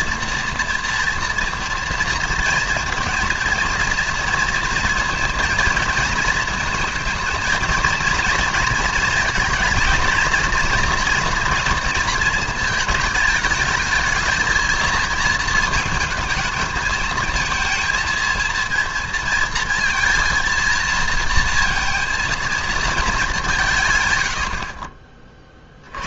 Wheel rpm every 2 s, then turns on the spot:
230, 230, 230, 230, 230, 230, 220, 220, 220, 230, 230, 230, 60.
none